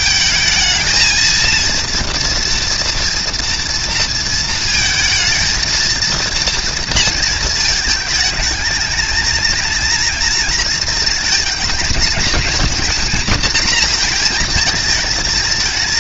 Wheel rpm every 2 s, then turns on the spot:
220, 240, 230, 230, 220, 230, 240, 220.
none